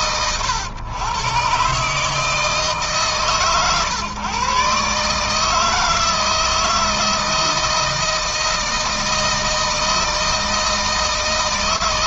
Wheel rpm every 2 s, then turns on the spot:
110, 150, 140, 160, 160, 160.
none